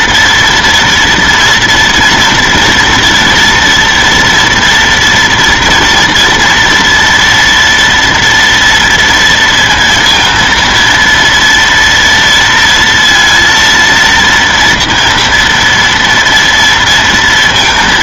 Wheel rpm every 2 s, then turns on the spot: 240, 240, 230, 230, 230, 230, 230, 230, 230.
none